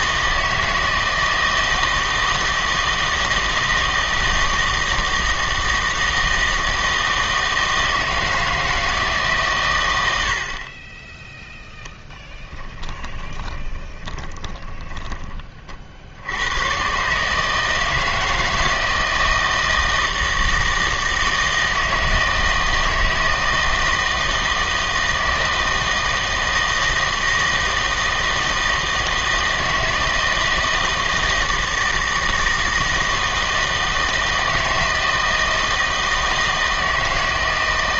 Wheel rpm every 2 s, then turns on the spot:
160, 160, 160, 160, 160, 40, 20, 20, 110, 160, 160, 160, 160, 160, 160, 160, 160, 160, 160.
12-16